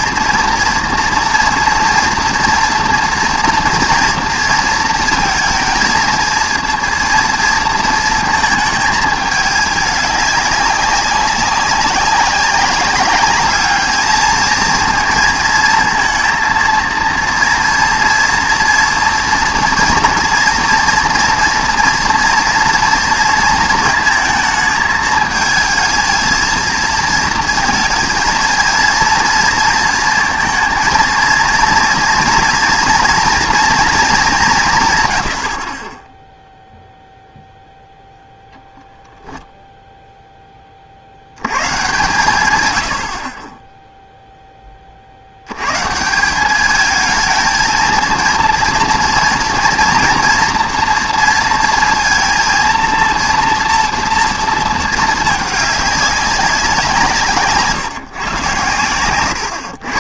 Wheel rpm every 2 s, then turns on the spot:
230, 230, 230, 230, 220, 200, 190, 220, 230, 230, 230, 230, 220, 230, 230, 230, 230, 160, 0, 0, 30, 90, 20, 210, 230, 230, 230, 220, 180, 120.
none